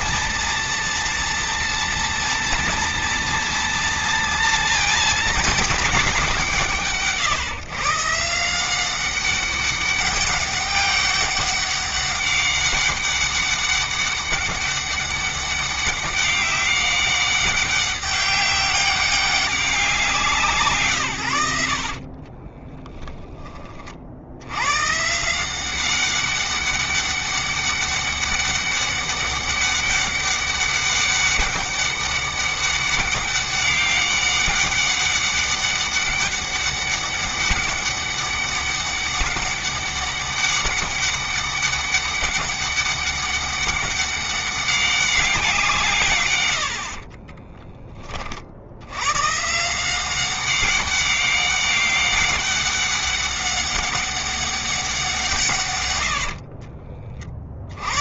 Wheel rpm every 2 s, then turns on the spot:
230, 230, 210, 140, 200, 200, 200, 200, 200, 200, 90, 30, 170, 200, 200, 200, 200, 200, 200, 200, 200, 200, 180, 20, 120, 200, 200, 170, 50.
20-22 46-48